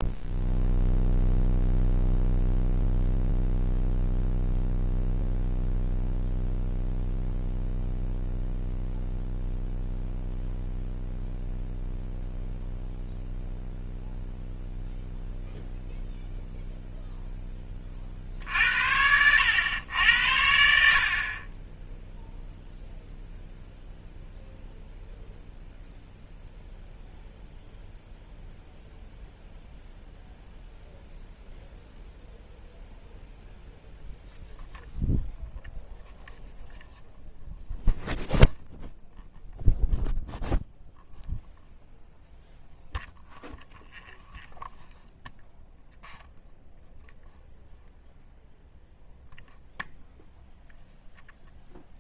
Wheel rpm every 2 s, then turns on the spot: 0, 0, 0, 0, 0, 0, 0, 0, 0, 80, 60, 0, 0, 0, 0, 0, 0, 0, 0, 0, 0, 0, 0, 0, 0, 0.
none